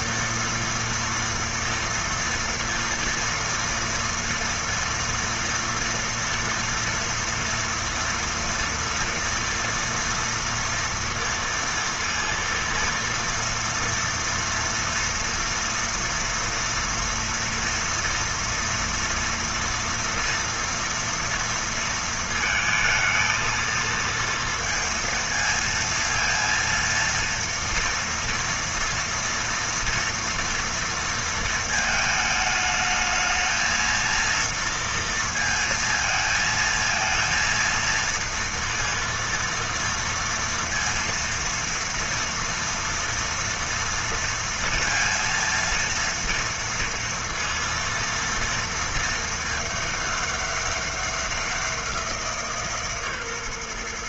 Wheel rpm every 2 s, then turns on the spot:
230, 230, 230, 230, 240, 230, 230, 230, 230, 230, 230, 230, 230, 230, 230, 230, 220, 230, 220, 230, 230, 230, 230, 230, 230, 210, 170.
none